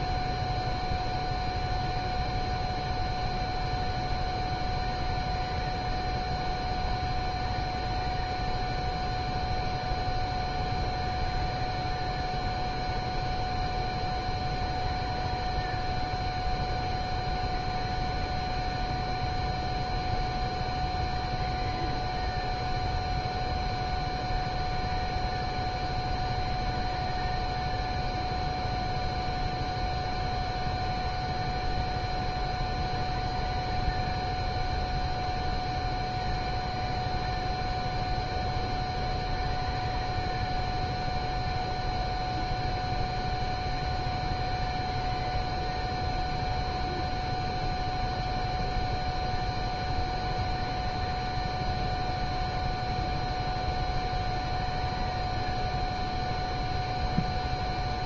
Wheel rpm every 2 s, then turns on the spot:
0, 0, 0, 0, 0, 0, 0, 0, 0, 0, 0, 0, 0, 0, 0, 0, 0, 0, 0, 0, 0, 0, 0, 0, 0, 0, 0, 0, 0.
none